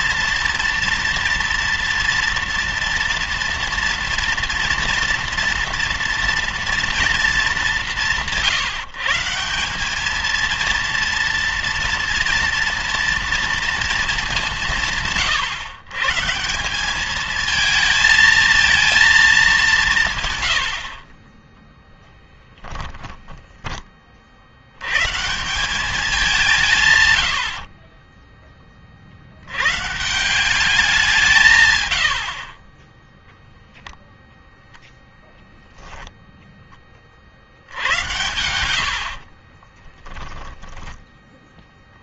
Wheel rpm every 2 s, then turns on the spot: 230, 230, 240, 230, 150, 230, 230, 170, 180, 220, 80, 10, 110, 150, 30, 190, 30, 0, 20, 80, 10.
22-24 38-40